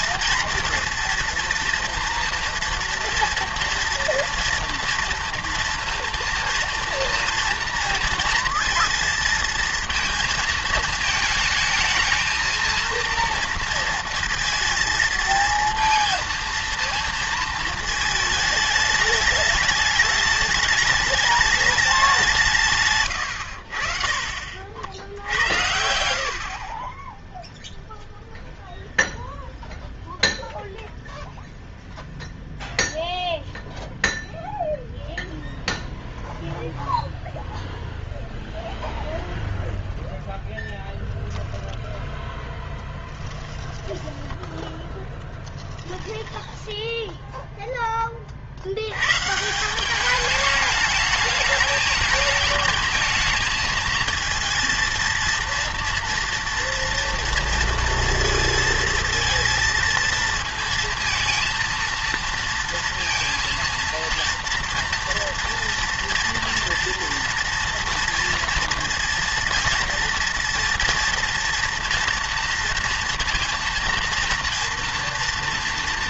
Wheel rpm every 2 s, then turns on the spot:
230, 230, 230, 230, 230, 220, 230, 230, 230, 210, 210, 160, 60, 40, 0, 0, 0, 0, 0, 0, 0, 10, 10, 10, 60, 210, 220, 230, 230, 230, 230, 230, 230, 230, 230, 230, 230, 230.
42-46